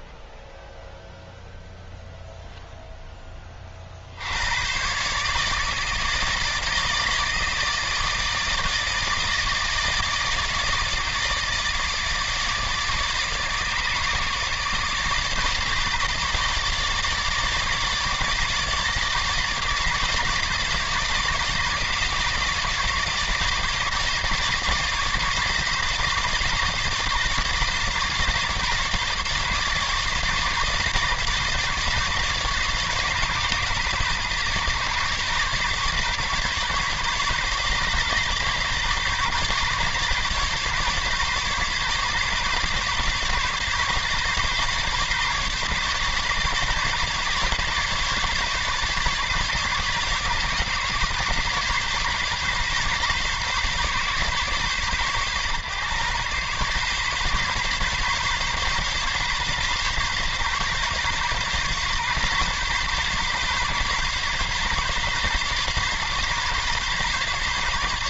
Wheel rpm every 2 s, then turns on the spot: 10, 0, 120, 160, 160, 160, 150, 150, 150, 150, 150, 150, 150, 150, 150, 150, 150, 150, 140, 140, 140, 150, 140, 140, 140, 140, 140, 130, 130, 140, 140, 140, 140, 140.
none